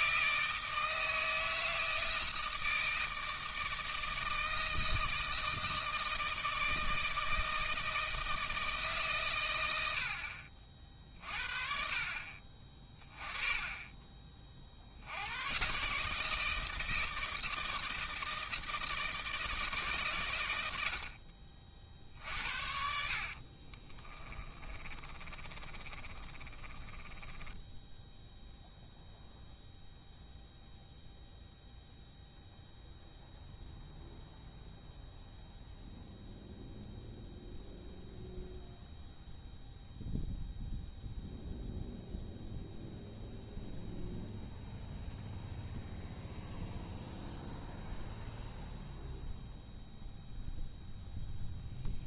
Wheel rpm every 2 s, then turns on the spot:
160, 160, 160, 160, 150, 50, 30, 50, 160, 170, 100, 50, 20, 20, 0, 0, 0, 0, 0, 0, 0, 0, 0, 0, 0, 0.
22-28